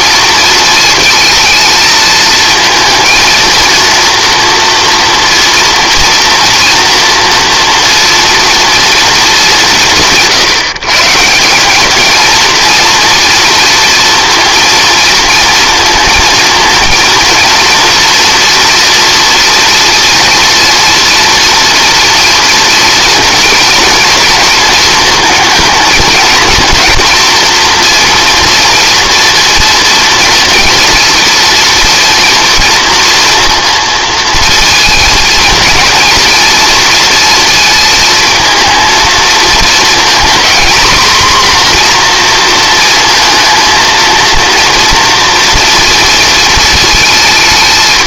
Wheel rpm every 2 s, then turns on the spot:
230, 220, 230, 230, 240, 160, 230, 230, 230, 230, 230, 230, 230, 230, 230, 230, 230, 230, 230, 230, 240, 230, 230, 230.
none